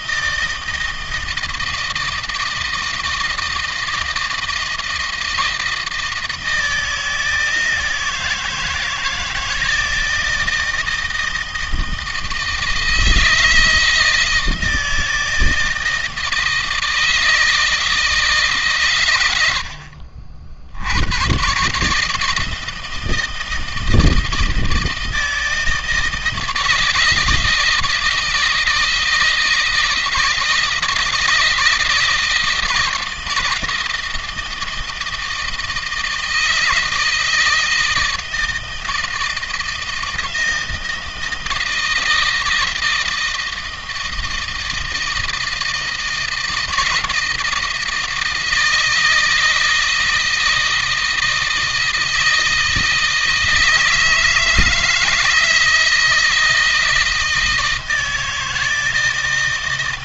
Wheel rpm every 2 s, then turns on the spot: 160, 160, 160, 160, 160, 160, 160, 160, 160, 130, 80, 160, 160, 160, 160, 160, 160, 160, 160, 160, 160, 160, 160, 160, 160, 160, 160, 160, 160, 160.
none